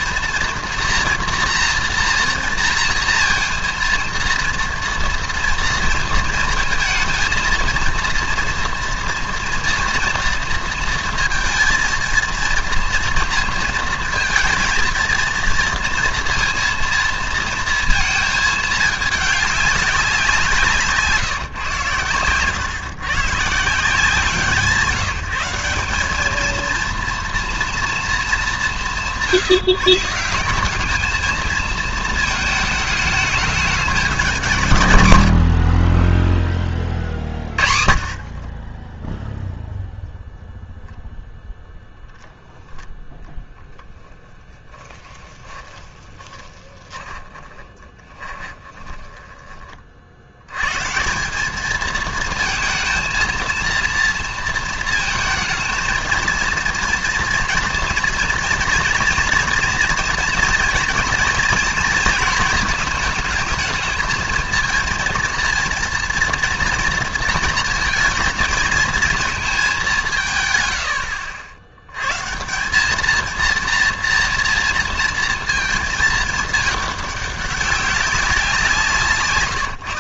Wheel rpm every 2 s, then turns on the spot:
240, 230, 230, 230, 230, 230, 230, 230, 230, 220, 170, 120, 170, 220, 190, 190, 220, 180, 20, 30, 0, 0, 10, 20, 20, 110, 220, 230, 230, 230, 230, 220, 220, 230, 220, 120, 180, 230, 210, 170.
44-50